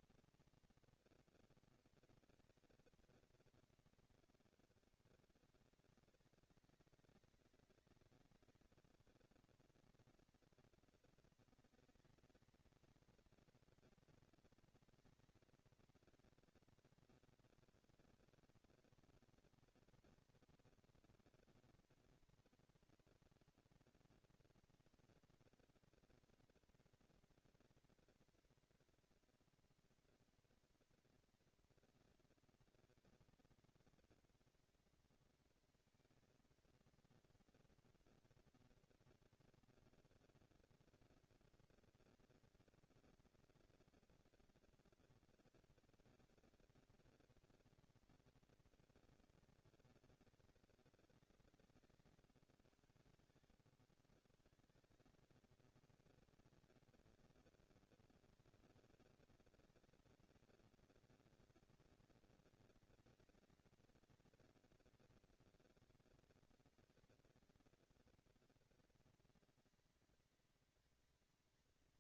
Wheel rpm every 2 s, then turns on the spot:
230, 230, 210, 190, 200, 230, 230, 230, 230, 230, 230, 230, 230, 230, 230, 230, 230, 230, 230, 230, 230, 230, 230, 230, 230, 200, 140, 170, 220, 230, 230, 230, 230, 230, 230, 230.
none